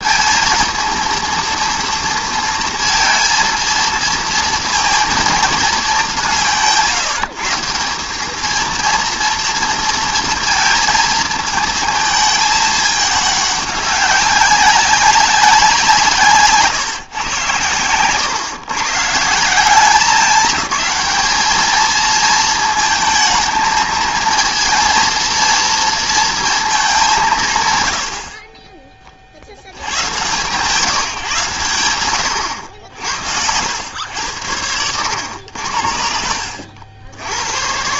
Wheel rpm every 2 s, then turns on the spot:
230, 230, 230, 160, 230, 230, 210, 200, 140, 140, 200, 230, 230, 210, 20, 160, 80, 100, 70.
34-36